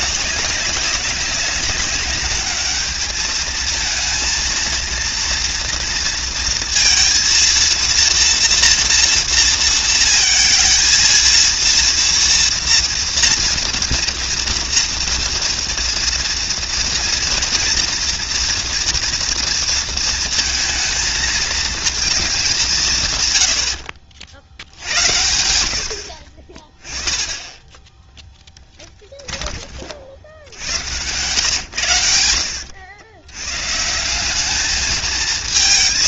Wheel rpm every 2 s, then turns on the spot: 190, 210, 230, 230, 230, 230, 230, 230, 230, 230, 230, 140, 80, 20, 10, 100, 90, 220.
28-30